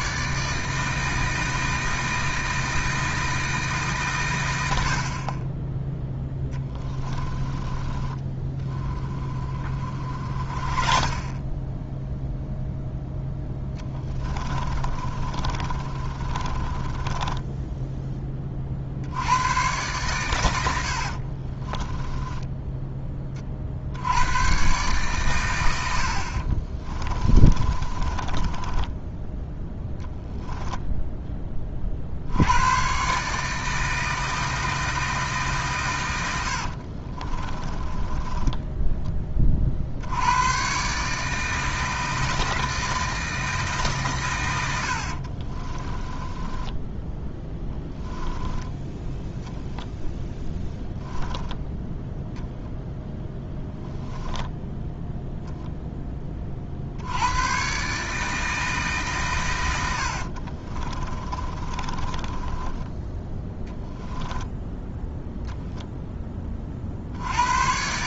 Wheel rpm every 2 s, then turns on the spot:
160, 160, 60, 10, 20, 30, 0, 30, 20, 50, 90, 20, 130, 20, 10, 10, 140, 160, 50, 10, 140, 160, 70, 10, 10, 10, 0, 0, 70, 140, 30, 10, 0, 50.
6-12 14-18 26-30 36-38 46-50 60-62